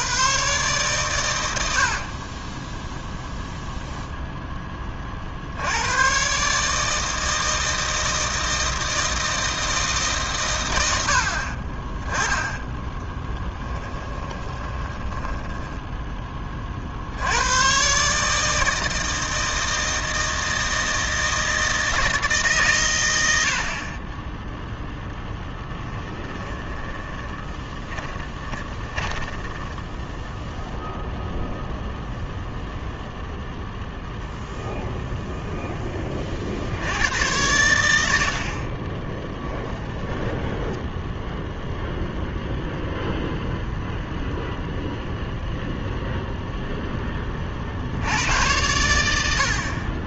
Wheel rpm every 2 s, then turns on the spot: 120, 10, 20, 150, 160, 100, 10, 20, 60, 160, 160, 130, 0, 30, 20, 0, 0, 0, 80, 30, 20, 0, 0, 10, 100.
14-16 26-30 38-42